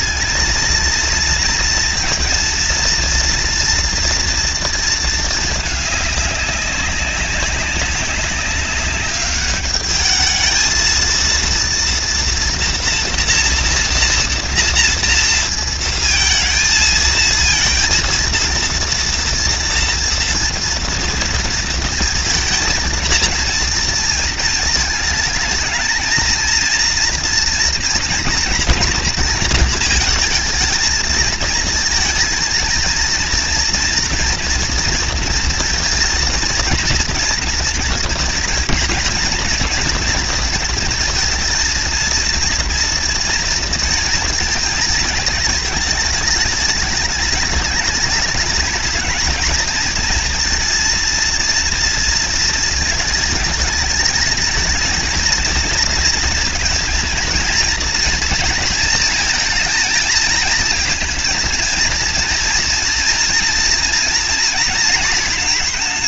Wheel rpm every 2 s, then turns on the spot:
230, 230, 220, 200, 200, 230, 240, 230, 220, 230, 230, 230, 220, 230, 230, 220, 230, 230, 230, 230, 230, 230, 220, 210, 220, 230, 220, 230, 230, 220, 230, 230, 230.
none